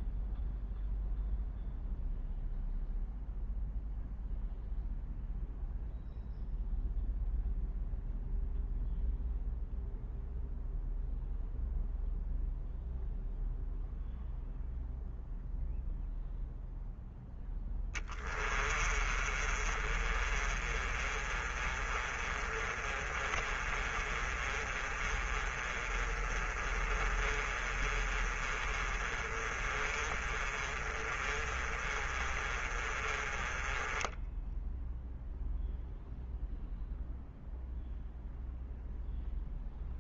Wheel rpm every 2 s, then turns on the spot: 0, 0, 0, 0, 0, 0, 0, 0, 0, 20, 30, 30, 30, 30, 30, 30, 30, 10, 0, 0.
18-36